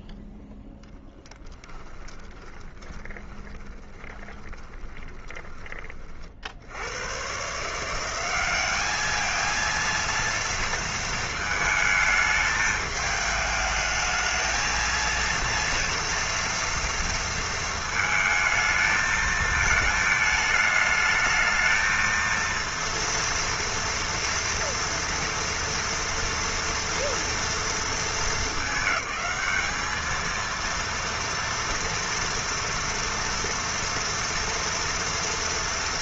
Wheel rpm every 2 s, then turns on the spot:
0, 20, 20, 60, 200, 230, 210, 220, 230, 220, 210, 230, 230, 230, 210, 230, 230, 240.
2-6